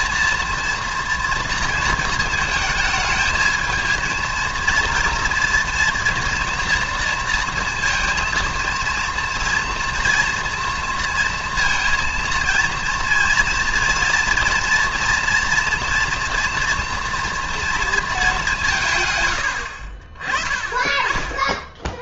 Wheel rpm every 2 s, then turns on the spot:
230, 220, 230, 240, 230, 230, 230, 230, 230, 180, 30.
none